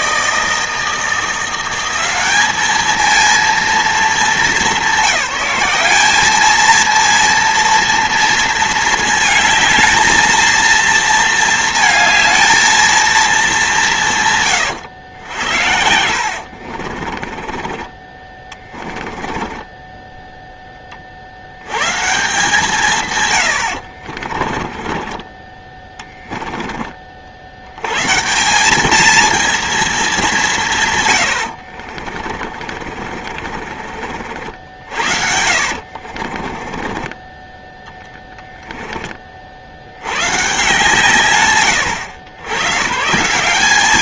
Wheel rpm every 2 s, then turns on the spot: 160, 190, 210, 210, 230, 220, 220, 140, 80, 20, 10, 130, 60, 10, 90, 220, 70, 50, 60, 10, 50, 110.
16-18 24-26 32-38